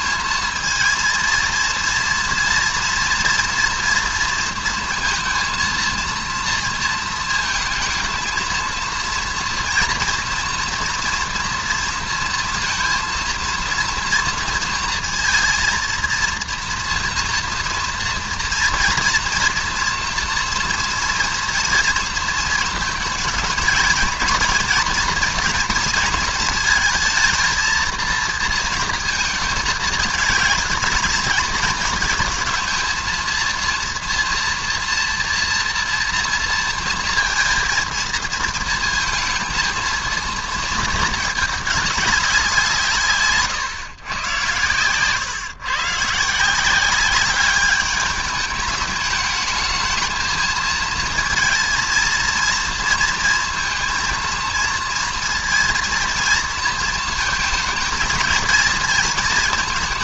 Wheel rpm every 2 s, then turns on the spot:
220, 230, 230, 230, 220, 230, 230, 230, 230, 230, 230, 230, 230, 220, 230, 210, 220, 230, 230, 230, 230, 170, 110, 160, 210, 220, 230, 230, 230, 230.
none